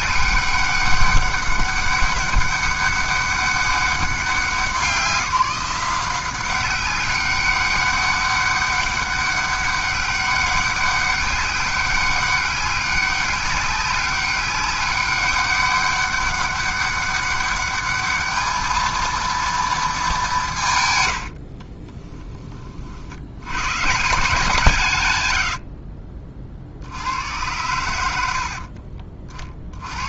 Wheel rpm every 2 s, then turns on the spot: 200, 200, 180, 190, 200, 200, 200, 200, 200, 220, 150, 40, 160, 60, 50.
none